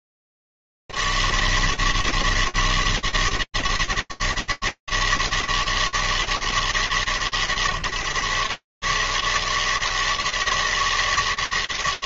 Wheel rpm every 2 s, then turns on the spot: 80, 160, 160, 160, 130, 160.
none